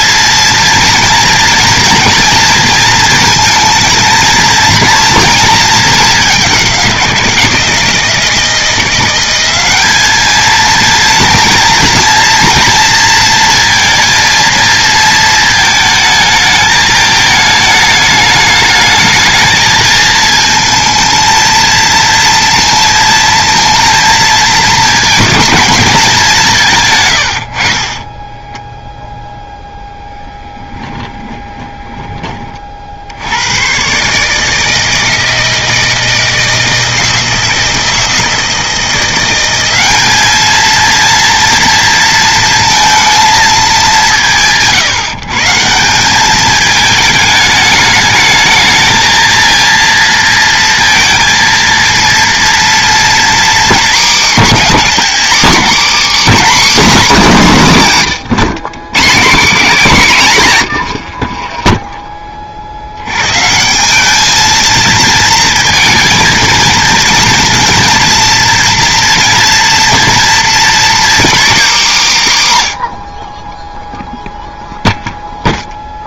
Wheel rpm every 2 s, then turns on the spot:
230, 230, 230, 190, 170, 230, 230, 230, 220, 210, 230, 230, 230, 150, 10, 10, 30, 160, 160, 170, 230, 230, 150, 210, 220, 230, 230, 230, 280, 160, 120, 60, 220, 230, 230, 250, 130, 0.
60-62